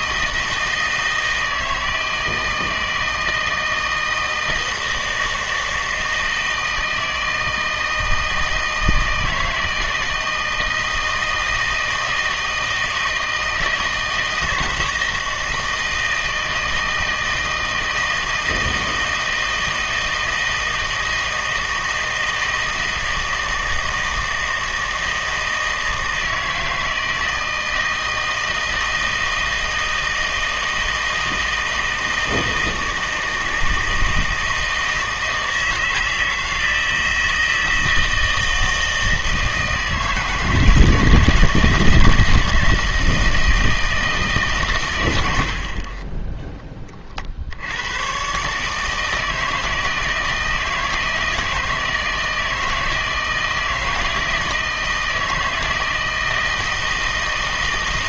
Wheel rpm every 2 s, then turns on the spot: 160, 160, 160, 160, 160, 160, 160, 160, 160, 160, 160, 160, 160, 160, 160, 160, 160, 160, 160, 160, 160, 160, 140, 10, 150, 160, 160, 160, 160.
none